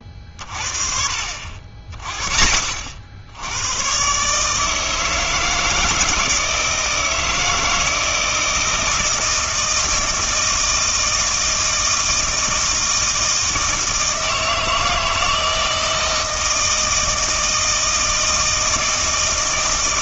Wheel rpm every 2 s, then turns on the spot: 40, 50, 150, 160, 160, 160, 160, 160, 160, 160.
none